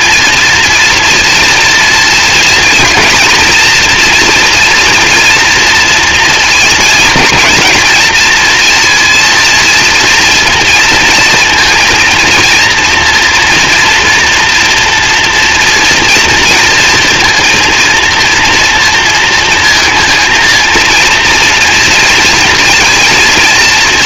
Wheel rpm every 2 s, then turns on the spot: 240, 230, 230, 230, 230, 230, 230, 240, 230, 230, 230, 230.
none